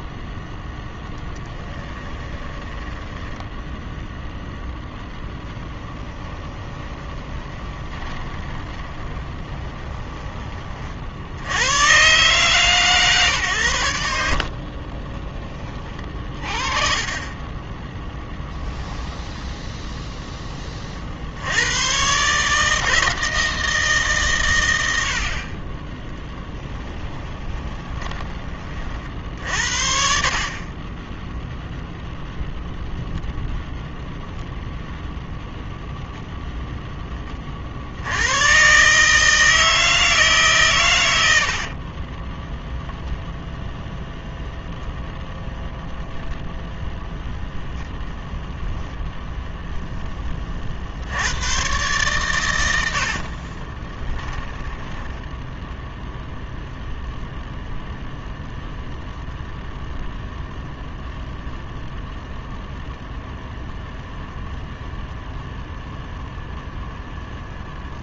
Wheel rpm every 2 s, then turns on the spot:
10, 10, 10, 20, 20, 50, 140, 30, 30, 10, 30, 160, 90, 10, 30, 30, 0, 0, 10, 140, 120, 0, 0, 0, 0, 60, 80, 10, 0, 0, 0, 0, 0, 0.
0-4 6-10 14-16 18-20 26-28 54-56